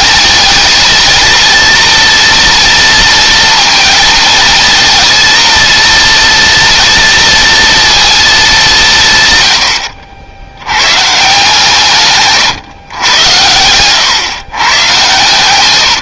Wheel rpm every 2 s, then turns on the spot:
230, 230, 230, 230, 160, 120, 110, 140.
none